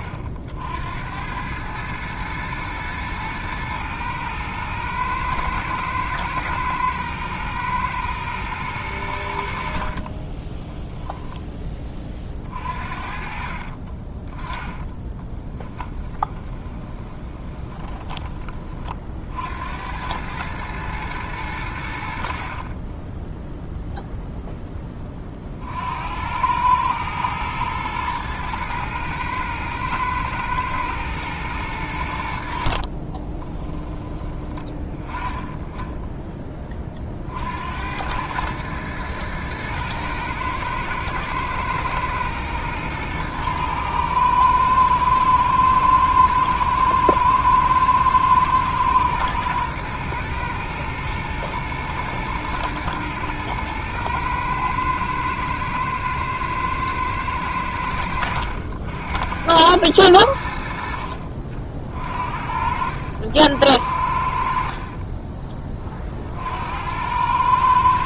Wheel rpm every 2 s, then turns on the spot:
60, 110, 110, 110, 110, 10, 40, 10, 20, 30, 110, 40, 10, 100, 110, 110, 60, 20, 30, 110, 120, 110, 110, 110, 110, 110, 110, 110, 120, 80, 50, 60, 40, 80.
10-12 14-18 22-24 32-34 64-66